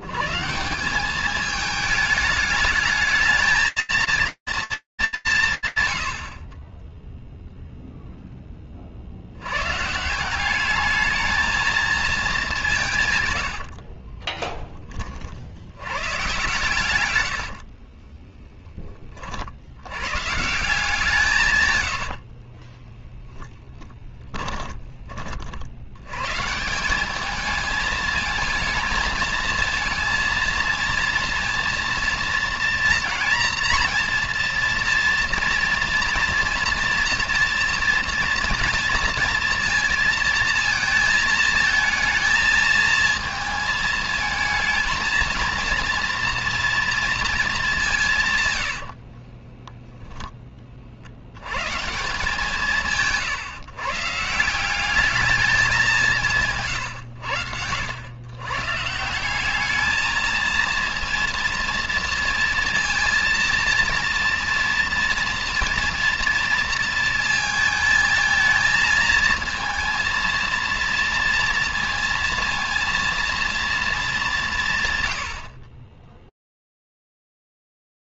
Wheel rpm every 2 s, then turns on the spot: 80, 210, 230, 70, 10, 190, 200, 30, 120, 20, 170, 10, 40, 210, 220, 230, 230, 230, 230, 230, 220, 220, 220, 230, 50, 80, 150, 210, 100, 190, 230, 230, 230, 220, 230, 230, 230, 110, 0.
22-24 48-50